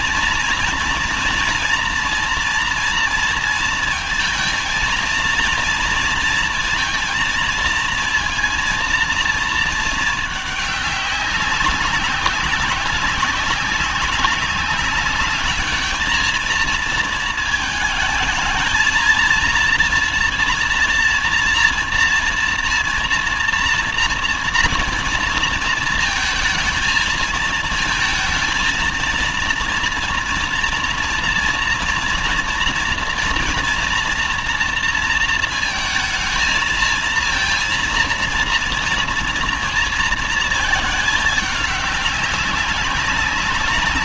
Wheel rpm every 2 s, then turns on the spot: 230, 230, 230, 230, 230, 210, 190, 200, 220, 220, 230, 230, 230, 220, 230, 230, 230, 230, 220, 230, 220, 190.
none